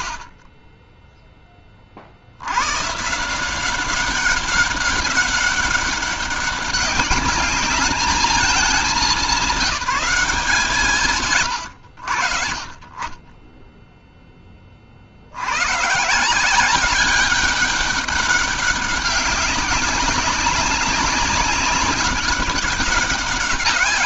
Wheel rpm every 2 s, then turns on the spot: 0, 150, 200, 200, 220, 110, 20, 90, 200, 200, 200, 150.
none